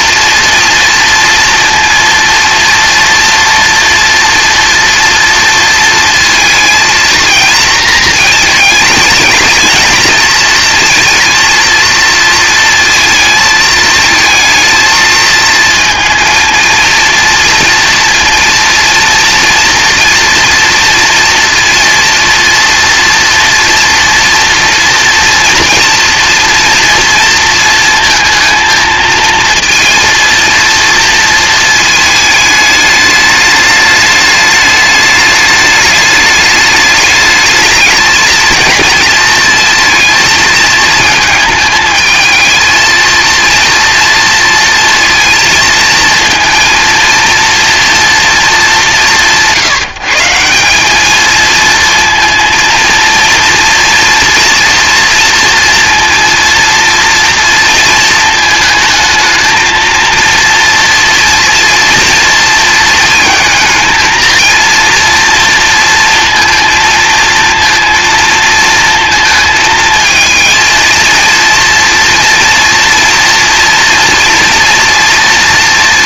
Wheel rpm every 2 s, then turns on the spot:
230, 230, 240, 230, 220, 230, 230, 230, 230, 230, 230, 230, 230, 230, 230, 230, 220, 210, 210, 230, 220, 220, 230, 230, 210, 190, 230, 230, 230, 220, 230, 230, 230, 230, 230, 220, 230, 230.
none